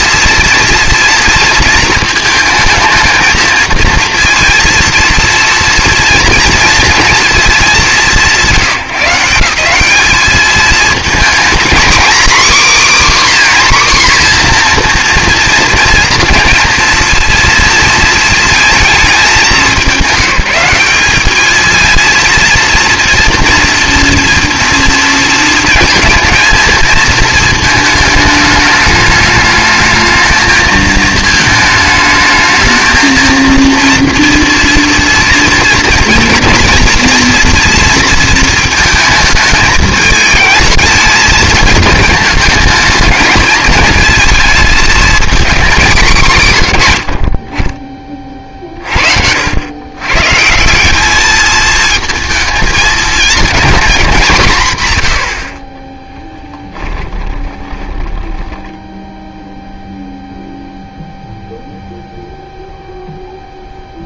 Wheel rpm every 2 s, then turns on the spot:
230, 220, 230, 230, 160, 220, 280, 240, 230, 230, 190, 230, 230, 230, 210, 220, 220, 230, 230, 220, 220, 220, 220, 140, 40, 170, 220, 150, 20, 10, 0, 0.
54-60